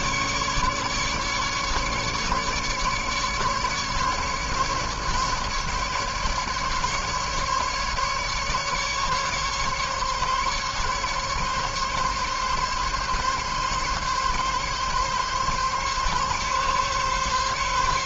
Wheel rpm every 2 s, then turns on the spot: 150, 140, 150, 140, 140, 140, 140, 140, 140.
none